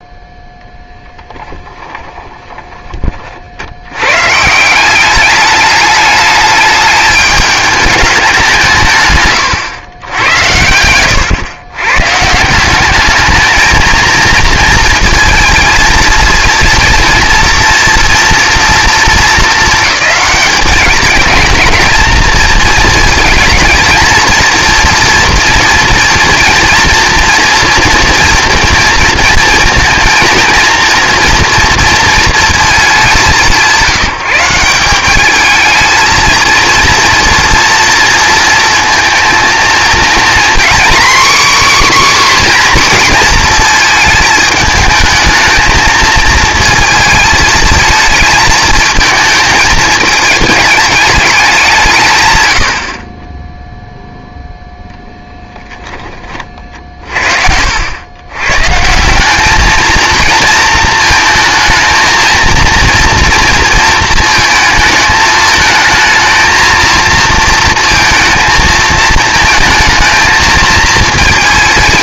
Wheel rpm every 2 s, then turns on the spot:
0, 20, 170, 210, 170, 100, 180, 230, 230, 240, 210, 230, 230, 230, 230, 230, 220, 180, 220, 230, 250, 260, 220, 220, 220, 220, 90, 0, 40, 130, 230, 230, 230, 230, 220, 220.
2-4